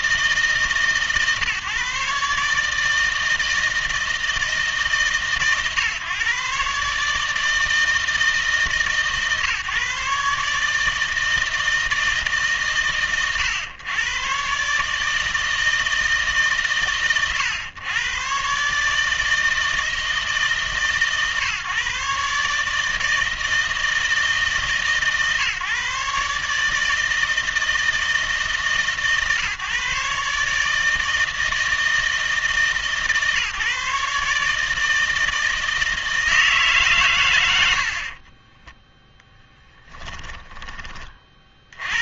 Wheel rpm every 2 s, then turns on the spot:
140, 150, 160, 140, 150, 150, 120, 150, 130, 150, 150, 150, 150, 150, 140, 150, 150, 160, 150, 10, 20.
38-40